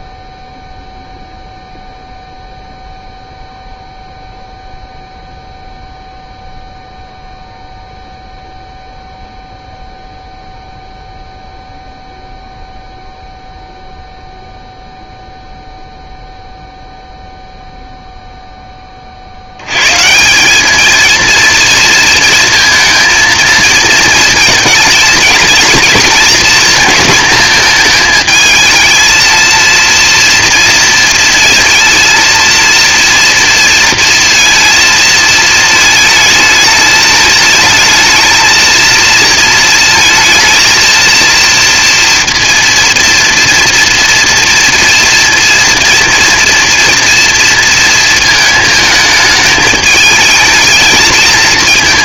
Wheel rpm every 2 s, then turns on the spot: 0, 0, 0, 0, 0, 0, 0, 0, 0, 10, 190, 230, 220, 230, 220, 230, 230, 230, 220, 230, 230, 230, 230, 230, 220, 220.
none